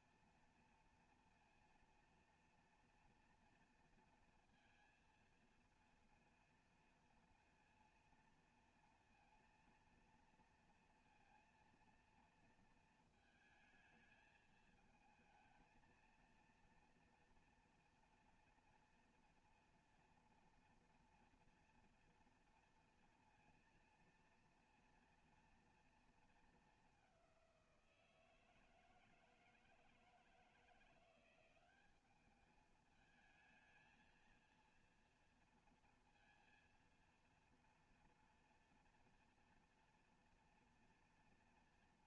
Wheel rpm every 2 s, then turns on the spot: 230, 230, 230, 230, 230, 230, 230, 220, 230, 230, 230, 240, 230, 200, 160, 170, 210, 230, 230, 240, 240.
none